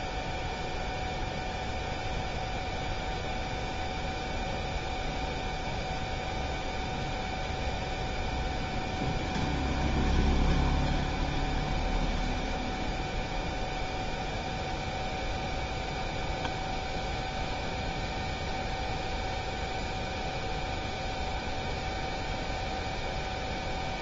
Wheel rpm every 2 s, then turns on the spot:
0, 0, 0, 0, 0, 0, 0, 0, 0, 0, 0, 0.
none